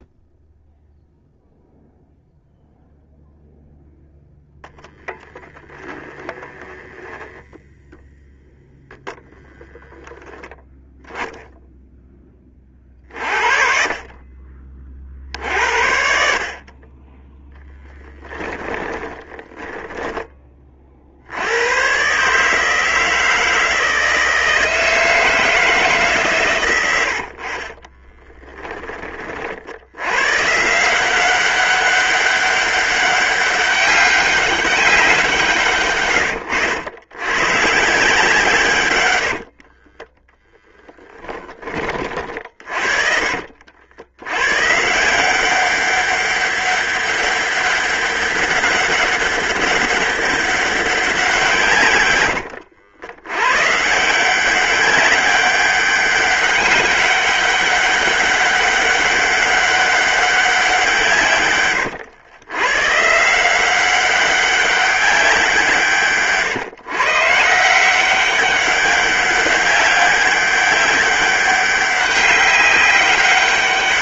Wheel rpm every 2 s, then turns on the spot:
0, 0, 0, 0, 0, 0, 30, 40, 20, 10, 50, 160, 160, 100, 20, 170, 200, 190, 110, 120, 10, 40, 160, 200, 200, 180, 70, 190, 200, 200, 160, 150, 200, 150, 190, 200, 200.
18-20 26-28 38-40